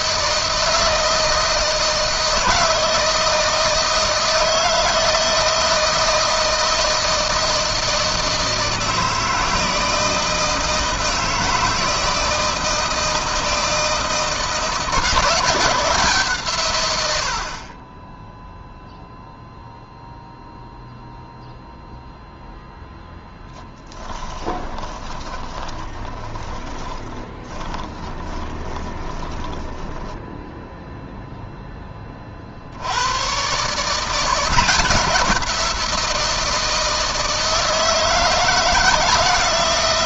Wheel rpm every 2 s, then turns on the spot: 160, 160, 160, 160, 160, 160, 160, 170, 100, 0, 0, 10, 20, 10, 20, 0, 100, 170, 160, 160.
24-30